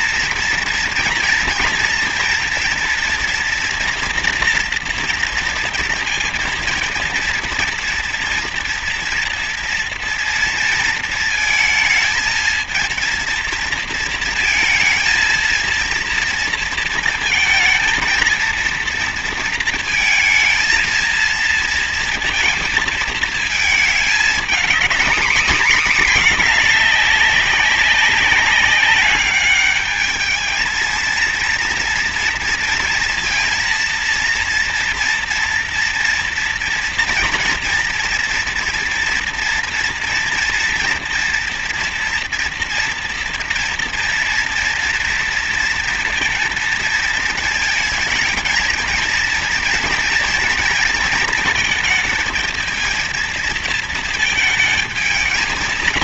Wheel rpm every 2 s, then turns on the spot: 230, 230, 230, 230, 230, 230, 230, 230, 230, 220, 220, 230, 230, 220, 200, 220, 230, 230, 230, 230, 230, 230, 230, 230, 220, 230, 230, 220.
none